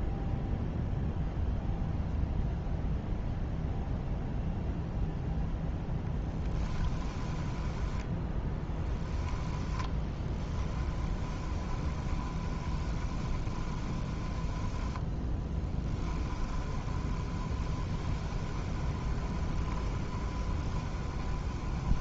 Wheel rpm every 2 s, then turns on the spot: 0, 0, 0, 0, 10, 20, 20, 0, 20, 20, 20.
8-14 16-22